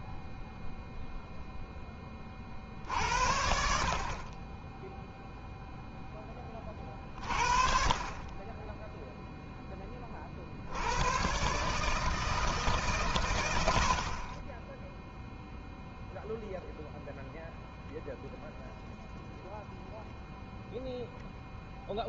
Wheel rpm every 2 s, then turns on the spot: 0, 60, 10, 30, 10, 70, 140, 10, 0, 0, 0.
none